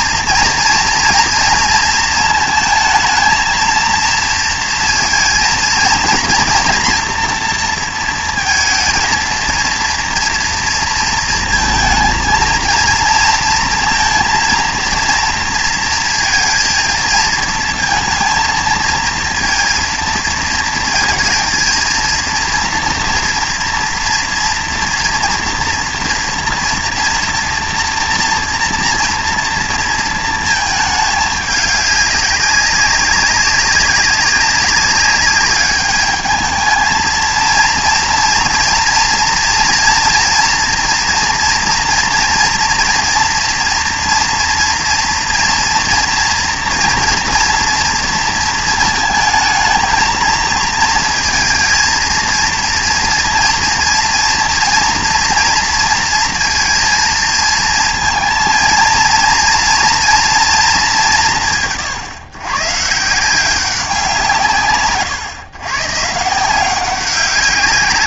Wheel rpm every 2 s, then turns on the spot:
230, 220, 230, 230, 230, 230, 230, 230, 230, 230, 230, 230, 230, 230, 230, 220, 190, 200, 220, 230, 230, 240, 230, 240, 220, 220, 230, 230, 230, 230, 220, 140, 140, 180.
none